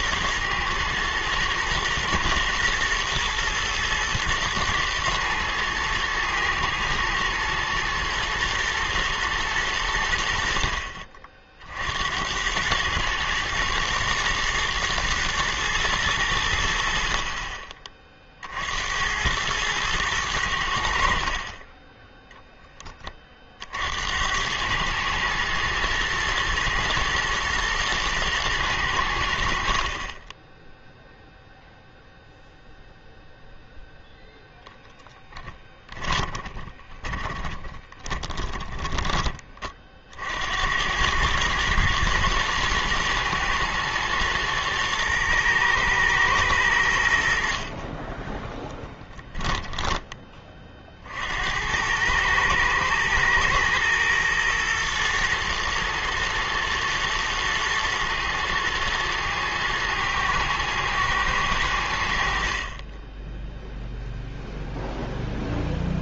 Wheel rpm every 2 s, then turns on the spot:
110, 120, 120, 120, 120, 60, 100, 110, 70, 70, 80, 20, 110, 110, 100, 10, 0, 0, 10, 10, 90, 110, 110, 100, 10, 40, 110, 120, 120, 110, 110, 40, 0.
30-32 36-40 48-50